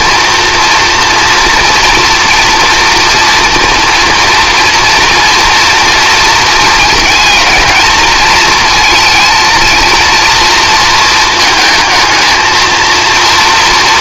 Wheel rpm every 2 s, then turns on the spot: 240, 230, 230, 220, 230, 230, 230.
none